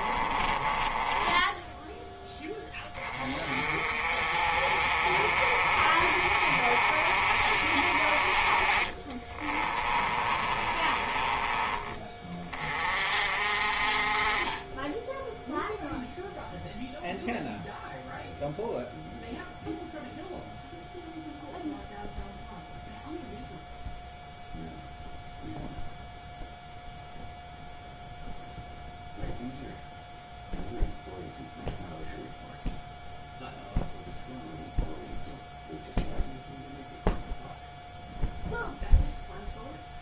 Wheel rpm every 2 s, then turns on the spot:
20, 20, 40, 40, 20, 20, 40, 10, 0, 0, 0, 0, 0, 0, 0, 0, 0, 0, 0, 0.
0-2 8-12